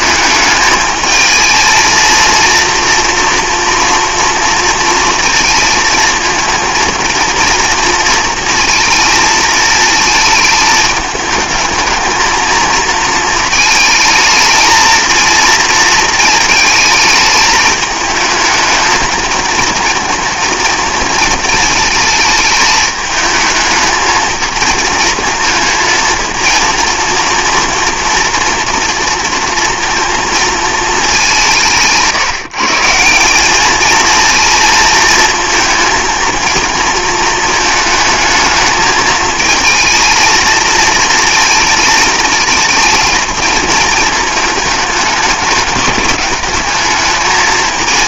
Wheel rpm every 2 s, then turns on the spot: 220, 240, 230, 230, 230, 220, 220, 220, 220, 220, 230, 220, 220, 230, 240, 220, 150, 230, 220, 220, 230, 230, 210, 210.
none